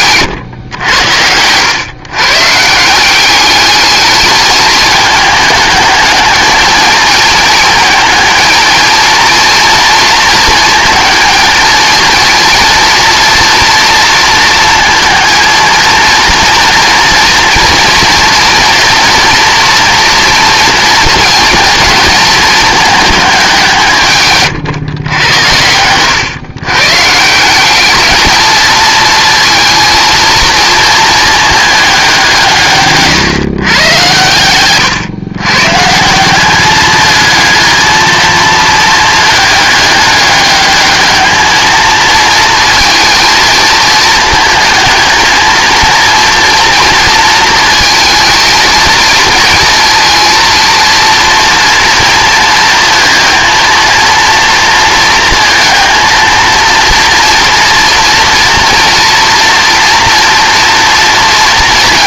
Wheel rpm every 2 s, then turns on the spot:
110, 160, 210, 220, 230, 220, 230, 230, 230, 230, 230, 220, 130, 120, 220, 230, 150, 120, 200, 220, 210, 230, 230, 230, 220, 230, 230, 230, 230, 230, 230.
none